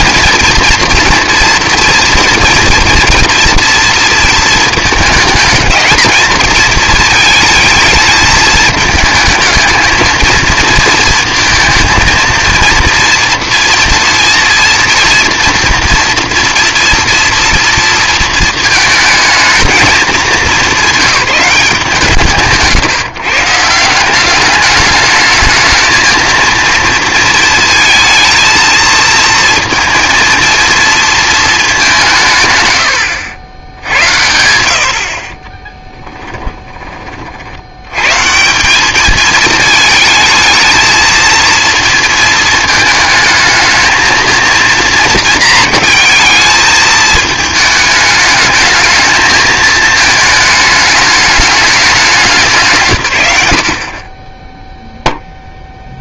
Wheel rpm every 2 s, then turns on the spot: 230, 230, 220, 220, 220, 220, 230, 230, 240, 220, 180, 160, 210, 230, 230, 230, 100, 70, 20, 200, 220, 220, 230, 220, 220, 210, 140, 0.
none